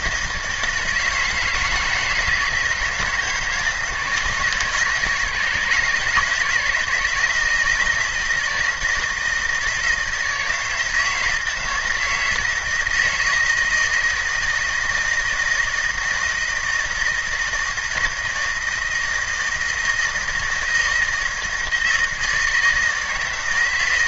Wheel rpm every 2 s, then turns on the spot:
160, 160, 160, 170, 160, 160, 160, 160, 160, 160, 160, 160.
none